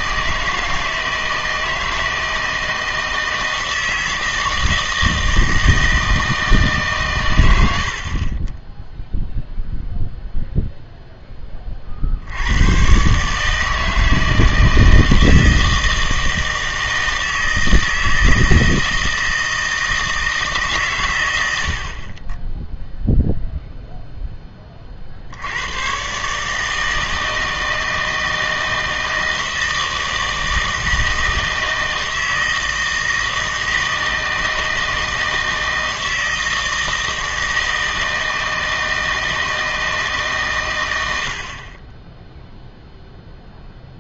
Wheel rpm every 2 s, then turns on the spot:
160, 160, 160, 150, 10, 0, 110, 160, 160, 160, 140, 0, 30, 160, 160, 160, 160, 160, 160, 160, 110, 0.
none